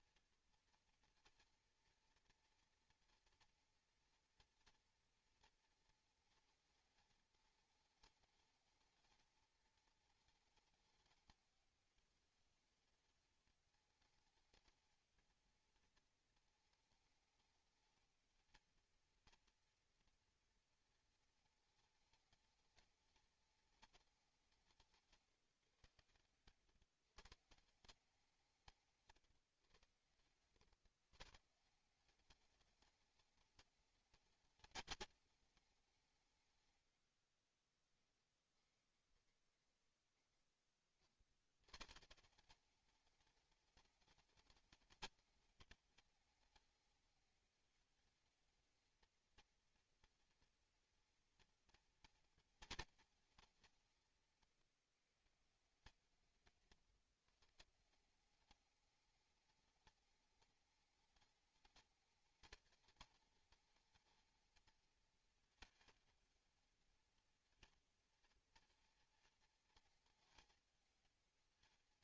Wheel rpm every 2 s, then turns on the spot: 240, 230, 230, 220, 210, 210, 210, 220, 220, 230, 230, 220, 170, 130, 160, 120, 210, 210, 110, 30, 30, 200, 220, 210, 220, 230, 230, 150, 170, 210, 210, 210, 220, 230, 230, 220.
36-40